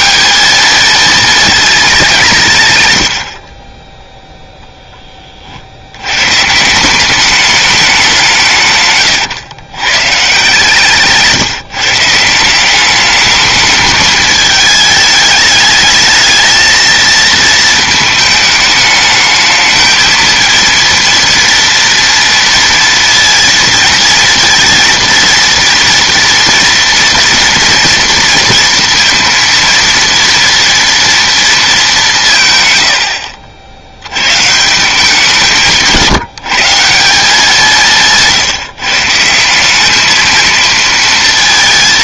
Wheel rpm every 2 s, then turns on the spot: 210, 130, 10, 170, 150, 160, 190, 210, 220, 210, 230, 230, 230, 230, 230, 230, 130, 150, 170, 140, 230.
none